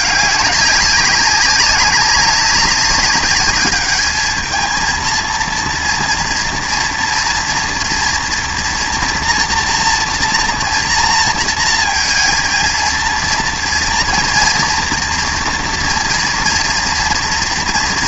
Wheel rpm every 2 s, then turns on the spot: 200, 200, 220, 230, 230, 230, 230, 230, 230.
none